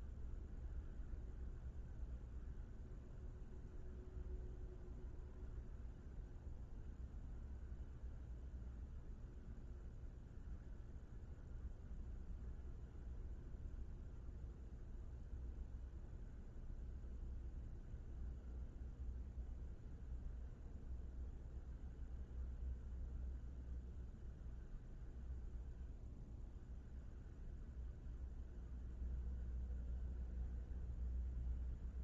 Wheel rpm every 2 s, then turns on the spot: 0, 0, 0, 0, 0, 0, 0, 0, 0, 0, 0, 0, 0, 0, 0, 0.
none